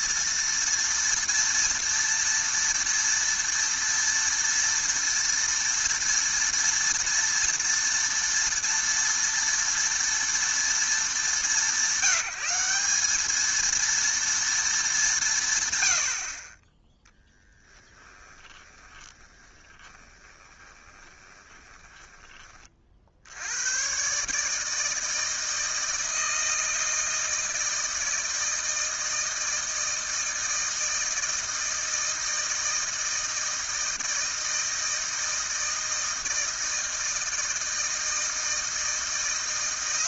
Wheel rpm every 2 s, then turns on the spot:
230, 230, 230, 230, 240, 210, 190, 220, 20, 20, 20, 30, 160, 160, 160, 160, 160, 160, 160, 160.
18-22